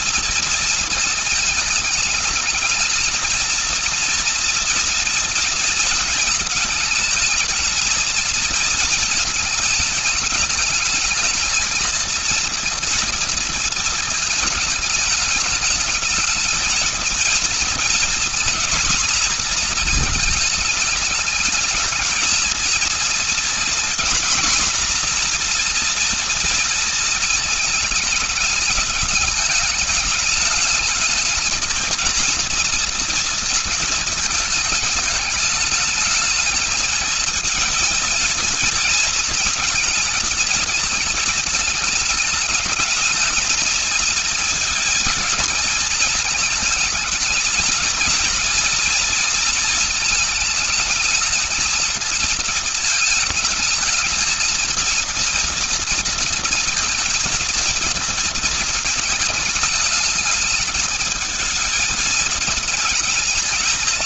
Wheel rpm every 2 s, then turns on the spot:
230, 220, 230, 220, 230, 220, 230, 220, 220, 230, 220, 220, 250, 230, 210, 210, 230, 220, 220, 220, 220, 210, 230, 220, 230, 220, 220, 220, 230, 220, 210, 220.
none